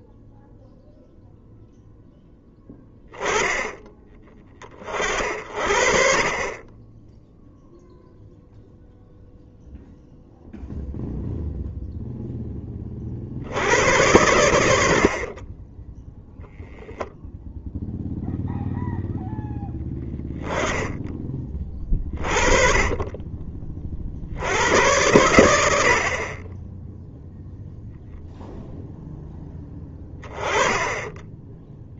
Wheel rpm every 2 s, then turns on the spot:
0, 10, 40, 20, 0, 0, 30, 70, 0, 0, 20, 40, 80, 0, 0, 20.
none